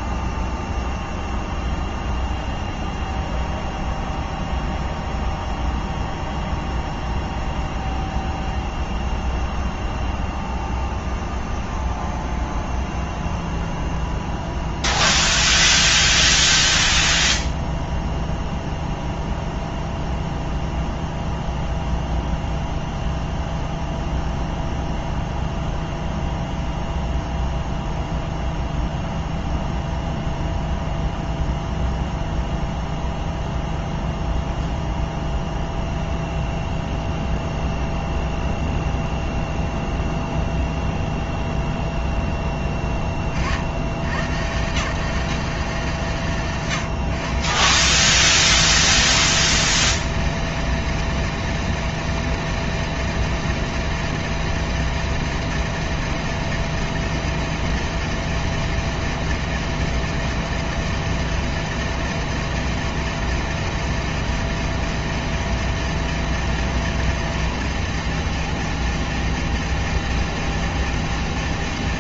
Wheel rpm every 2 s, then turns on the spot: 0, 0, 0, 0, 0, 0, 0, 0, 0, 0, 0, 0, 0, 0, 0, 0, 0, 0, 0, 0, 0, 10, 140, 150, 200, 210, 210, 210, 210, 210, 210, 210, 210, 210, 210, 210.
none